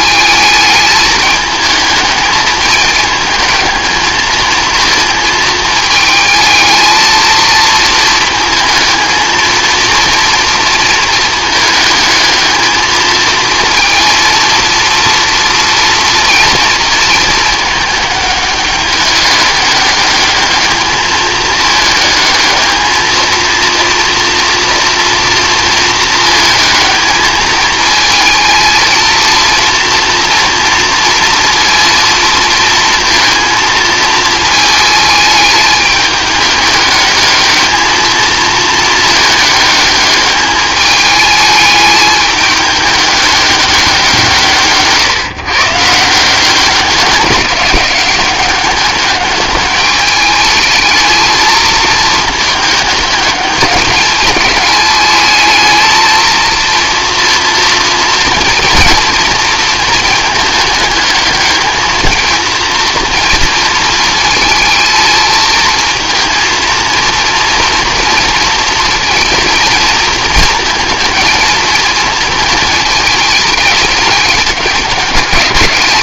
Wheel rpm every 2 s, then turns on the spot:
220, 220, 220, 220, 220, 230, 220, 230, 230, 200, 210, 220, 230, 220, 230, 230, 230, 220, 210, 220, 210, 210, 150, 190, 200, 210, 210, 210, 230, 230, 210, 230, 220, 230, 230, 230, 220, 190.
none